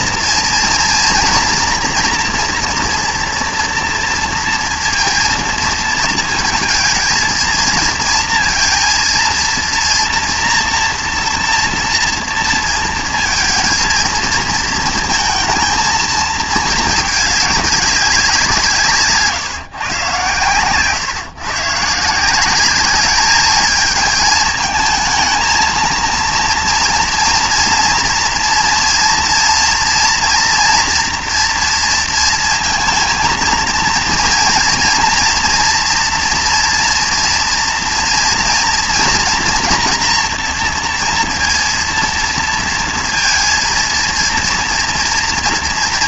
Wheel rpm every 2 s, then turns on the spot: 240, 240, 230, 230, 230, 240, 230, 220, 220, 160, 120, 200, 220, 230, 230, 230, 230, 230, 230, 240, 240, 230, 230.
none